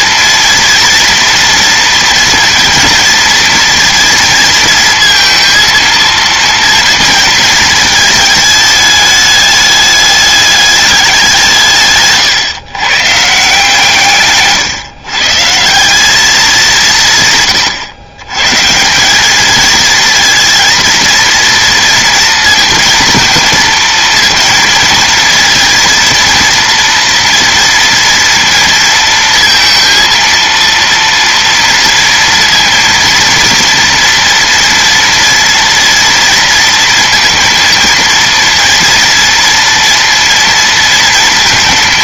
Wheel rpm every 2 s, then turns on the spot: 230, 230, 230, 230, 210, 210, 130, 140, 180, 160, 230, 230, 230, 230, 230, 230, 230, 230, 230, 230, 230.
none